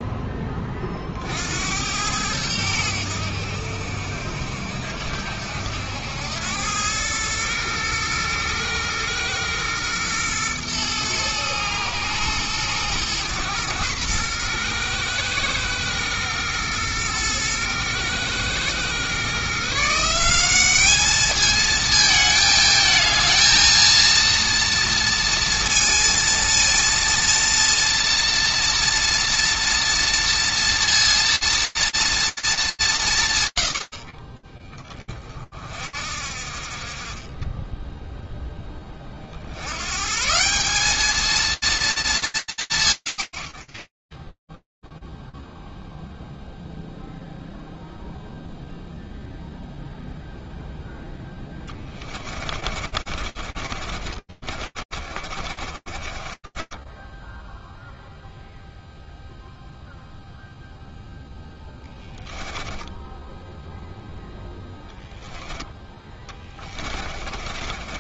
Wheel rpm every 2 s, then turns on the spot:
0, 90, 70, 80, 110, 120, 110, 120, 110, 110, 160, 220, 230, 230, 230, 230, 230, 60, 50, 10, 140, 220, 70, 0, 0, 0, 20, 30, 40, 0, 0, 10, 10, 30.
52-58 66-68